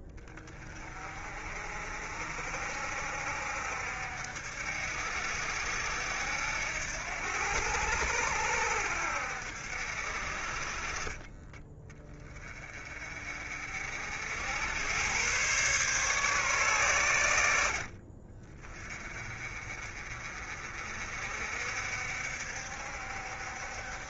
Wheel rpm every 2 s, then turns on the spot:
30, 60, 70, 80, 70, 30, 30, 100, 110, 30, 50, 60.
none